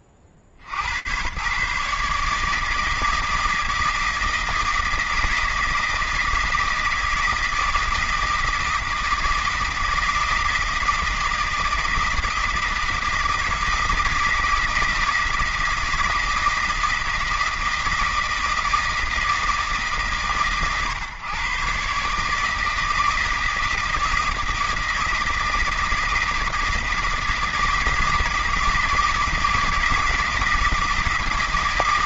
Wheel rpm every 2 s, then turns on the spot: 70, 160, 160, 160, 160, 160, 160, 160, 160, 160, 120, 160, 160, 160, 160, 160.
none